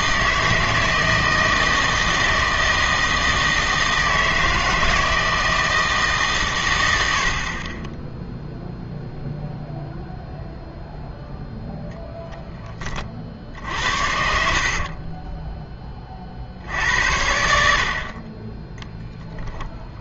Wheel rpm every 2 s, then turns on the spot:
160, 160, 160, 110, 0, 0, 20, 50, 60, 10.
14-16